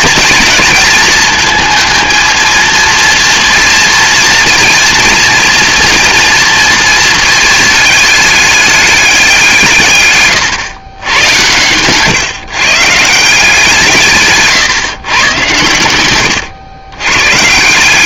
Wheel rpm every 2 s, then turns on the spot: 220, 230, 230, 230, 210, 110, 140, 130, 120.
none